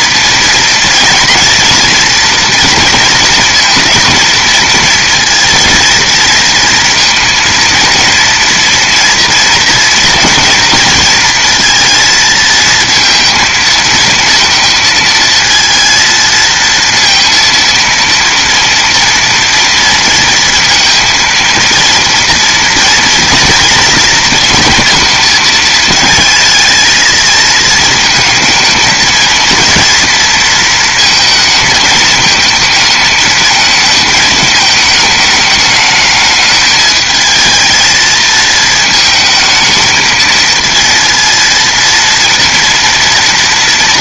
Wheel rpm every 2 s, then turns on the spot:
230, 230, 230, 230, 230, 230, 230, 230, 230, 230, 230, 230, 230, 220, 230, 220, 220, 220, 220, 220, 230, 230.
none